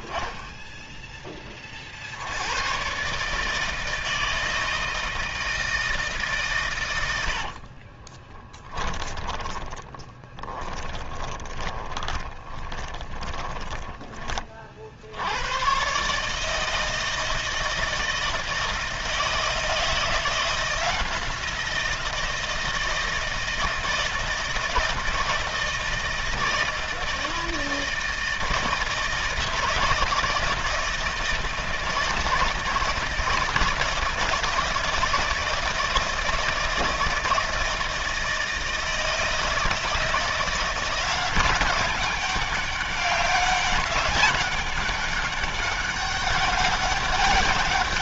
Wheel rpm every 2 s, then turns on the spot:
20, 80, 160, 140, 10, 10, 20, 20, 150, 160, 170, 160, 160, 160, 160, 160, 160, 160, 160, 160, 170, 200, 200, 200.
8-14